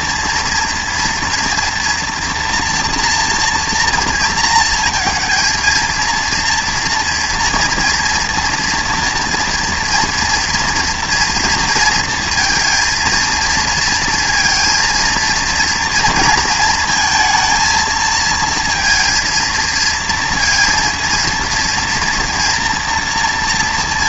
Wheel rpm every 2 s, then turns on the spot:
230, 240, 230, 230, 230, 230, 230, 230, 220, 230, 230, 230.
none